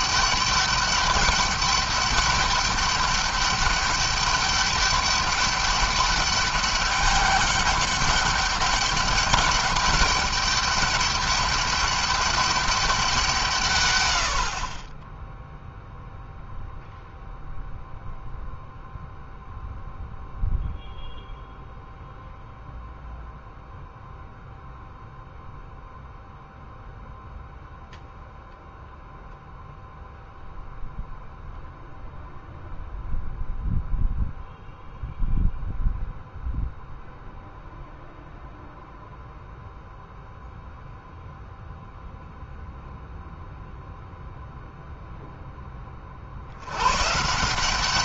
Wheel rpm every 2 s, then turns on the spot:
200, 200, 200, 200, 200, 200, 190, 30, 0, 0, 0, 0, 0, 0, 0, 0, 0, 0, 0, 0, 0, 0, 0, 110.
none